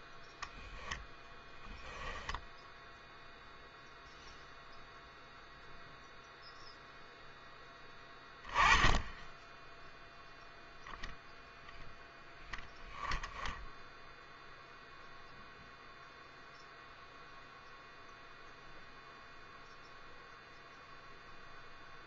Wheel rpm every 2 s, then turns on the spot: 0, 0, 0, 0, 10, 0, 0, 0, 0, 0, 0.
none